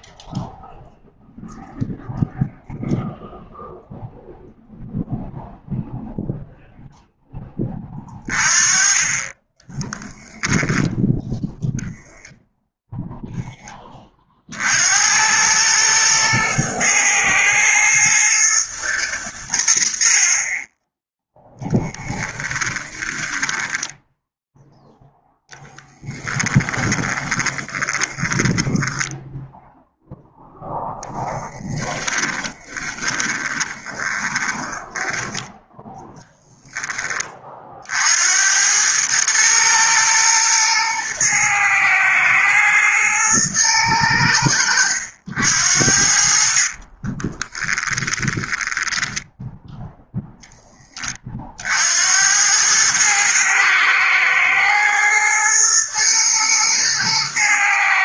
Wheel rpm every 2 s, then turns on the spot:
0, 0, 0, 0, 20, 0, 0, 80, 110, 100, 10, 10, 0, 20, 10, 0, 10, 10, 20, 110, 110, 120, 90, 40, 10, 30, 110, 110, 110.
22-24 26-28 32-36 46-50